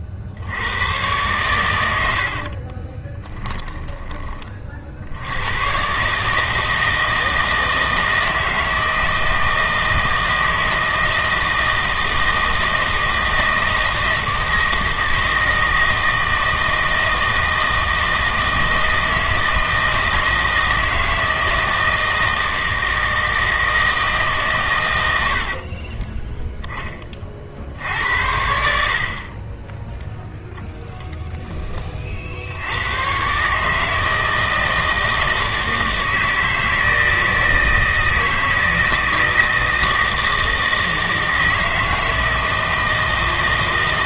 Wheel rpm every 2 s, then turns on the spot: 90, 40, 50, 160, 160, 160, 160, 160, 160, 160, 160, 160, 110, 10, 70, 0, 90, 160, 160, 160, 160, 160.
2-4